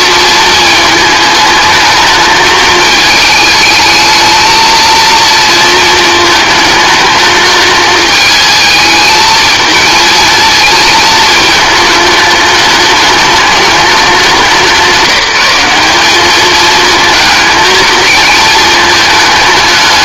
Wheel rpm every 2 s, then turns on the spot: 220, 220, 230, 210, 220, 220, 210, 170, 220, 220.
none